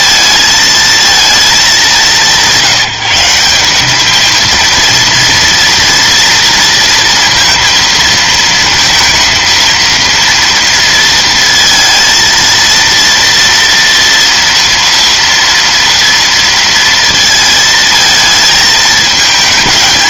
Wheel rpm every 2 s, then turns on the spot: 220, 180, 230, 230, 230, 230, 230, 230, 230, 220.
none